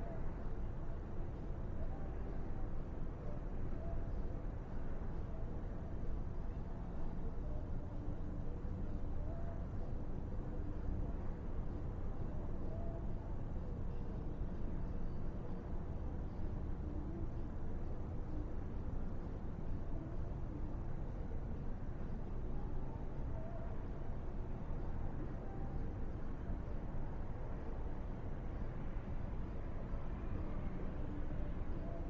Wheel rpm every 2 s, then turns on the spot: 0, 0, 0, 0, 0, 0, 0, 0, 0, 0, 0, 0, 0, 0, 0, 0.
none